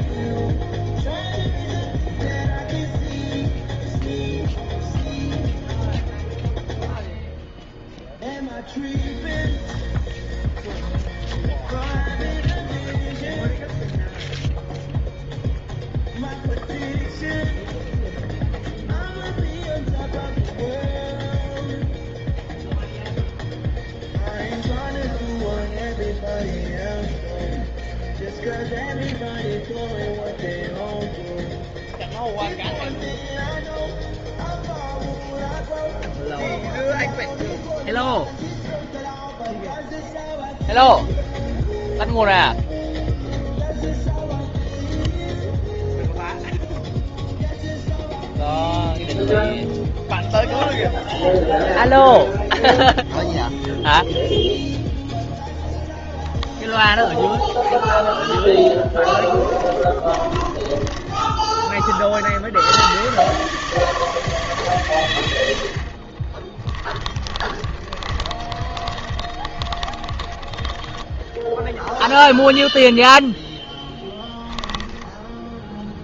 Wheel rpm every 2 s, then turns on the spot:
0, 0, 0, 0, 0, 0, 0, 0, 0, 0, 0, 0, 0, 0, 0, 0, 0, 0, 0, 0, 0, 0, 0, 0, 0, 0, 0, 0, 0, 10, 20, 80, 140, 30, 30, 20, 0, 10.
58-62 66-72 74-76